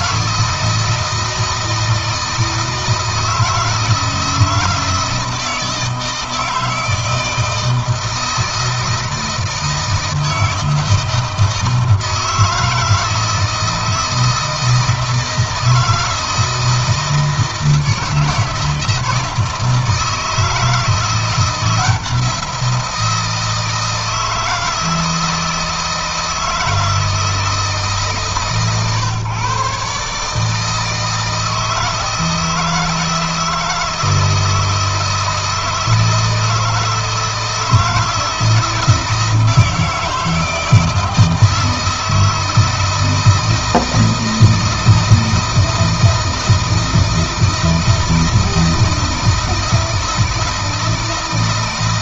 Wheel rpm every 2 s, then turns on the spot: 160, 160, 160, 160, 160, 160, 160, 160, 160, 160, 160, 170, 160, 160, 140, 150, 160, 160, 160, 160, 160, 160, 160, 160, 160, 160.
none